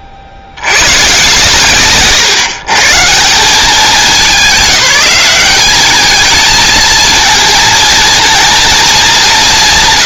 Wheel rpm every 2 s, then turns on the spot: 40, 140, 190, 220, 230.
none